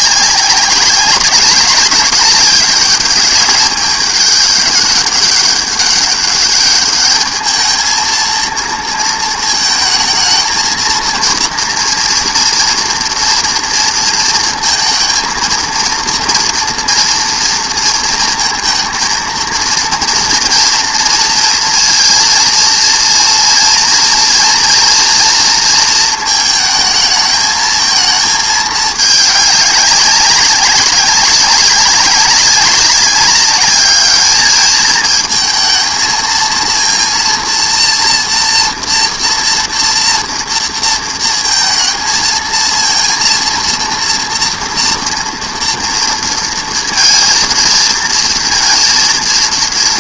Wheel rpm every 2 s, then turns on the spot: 190, 200, 210, 210, 230, 230, 230, 230, 230, 230, 230, 230, 230, 220, 220, 200, 200, 220, 230, 230, 230, 230, 230, 230, 230.
none